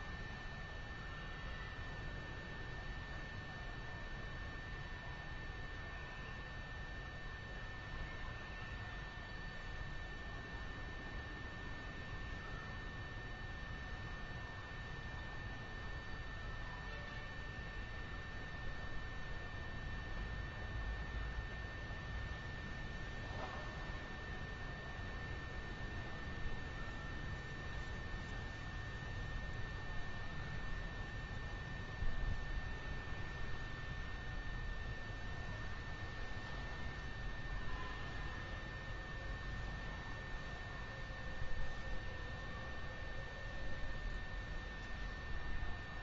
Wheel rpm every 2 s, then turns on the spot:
0, 0, 0, 0, 0, 0, 0, 0, 0, 0, 0, 0, 0, 0, 0, 0, 0, 0, 0, 0, 0, 0, 0.
none